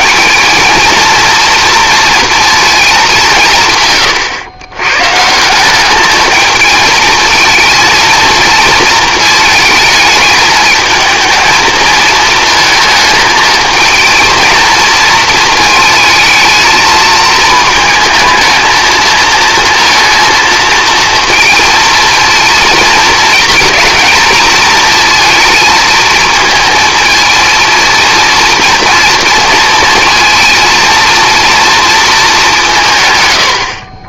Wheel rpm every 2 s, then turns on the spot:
220, 220, 120, 220, 230, 220, 220, 220, 220, 220, 230, 230, 230, 230, 230, 230, 180.
none